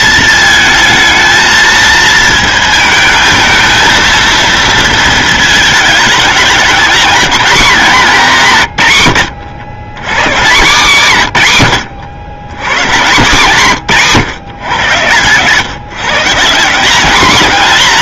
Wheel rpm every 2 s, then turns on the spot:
220, 220, 230, 210, 160, 160, 120, 120, 180.
none